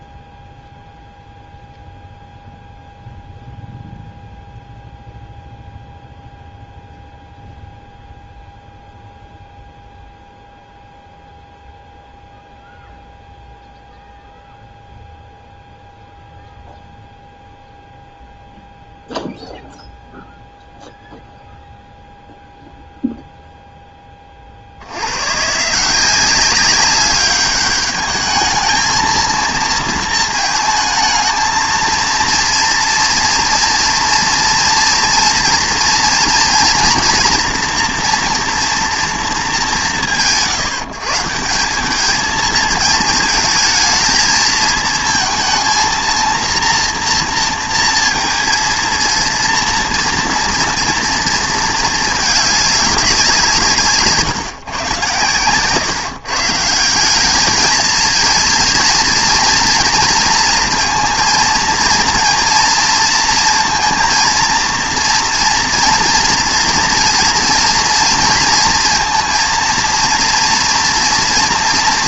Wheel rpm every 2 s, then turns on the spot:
0, 0, 0, 0, 0, 0, 0, 0, 0, 0, 0, 0, 70, 190, 220, 220, 230, 230, 230, 230, 140, 230, 220, 230, 230, 230, 200, 130, 160, 230, 230, 230, 230, 230, 230, 240.
none